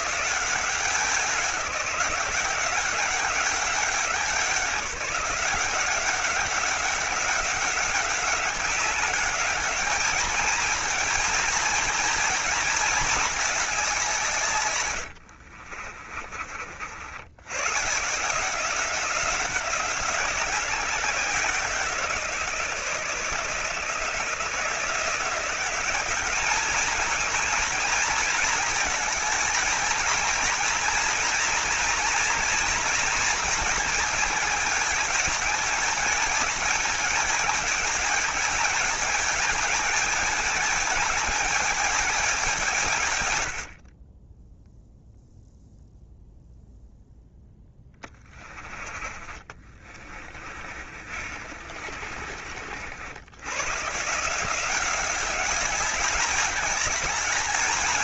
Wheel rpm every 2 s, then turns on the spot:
190, 180, 190, 190, 200, 220, 220, 100, 60, 180, 180, 160, 160, 210, 230, 230, 230, 220, 220, 220, 220, 180, 0, 0, 30, 40, 60, 180, 210.
14-16 50-52